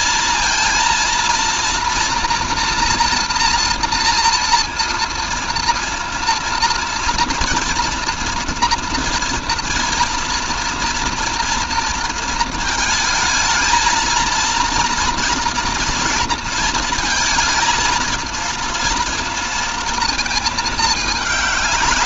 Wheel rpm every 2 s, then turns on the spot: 230, 240, 230, 230, 230, 230, 220, 230, 230, 230, 220.
none